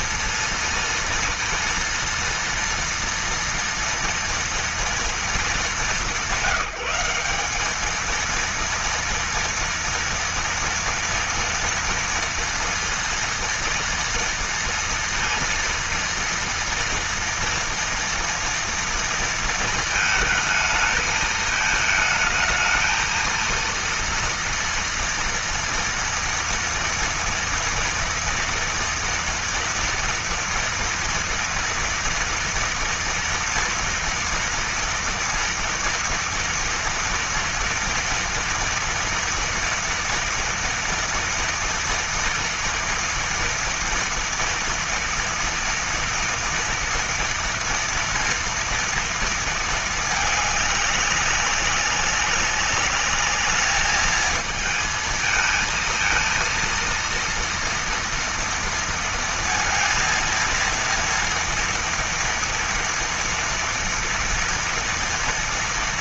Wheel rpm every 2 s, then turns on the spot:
230, 230, 230, 200, 230, 230, 230, 230, 230, 230, 220, 220, 230, 230, 230, 230, 230, 230, 230, 230, 230, 230, 240, 240, 230, 200, 200, 220, 230, 230, 230, 230, 230.
none